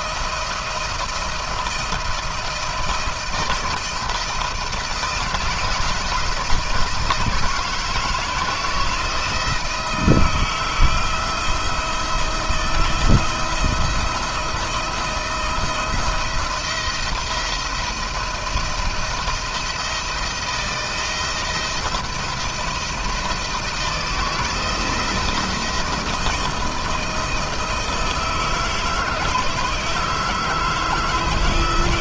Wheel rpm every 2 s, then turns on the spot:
170, 170, 160, 170, 160, 160, 170, 170, 170, 170, 170, 170, 160, 170, 160, 160.
none